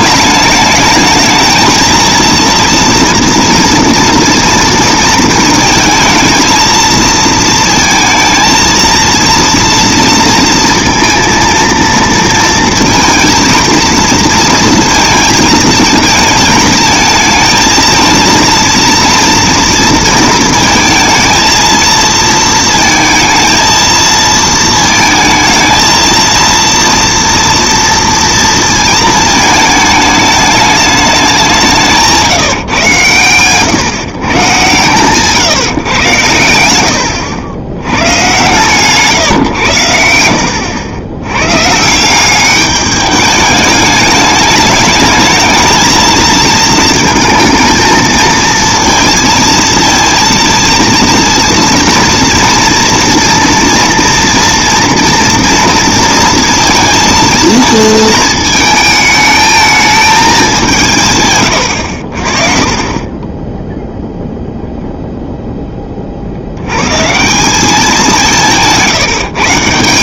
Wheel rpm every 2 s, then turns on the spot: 230, 230, 220, 220, 230, 230, 230, 220, 230, 230, 230, 230, 230, 230, 210, 160, 130, 110, 120, 80, 180, 210, 220, 230, 230, 230, 230, 230, 220, 220, 60, 0, 30, 190, 150.
none